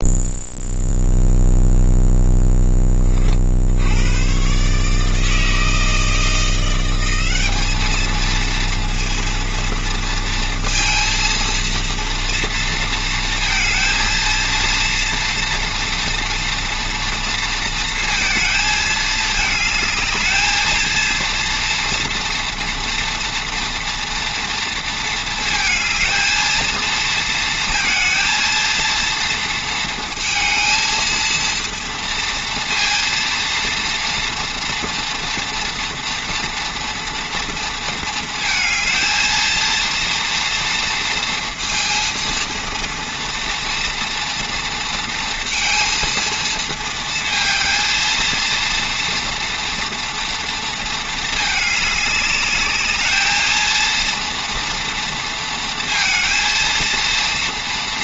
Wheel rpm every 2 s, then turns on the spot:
0, 20, 150, 180, 230, 230, 230, 230, 230, 220, 230, 230, 230, 230, 230, 220, 230, 230, 230, 220, 230, 240, 230, 230, 230, 230, 210, 230, 230.
none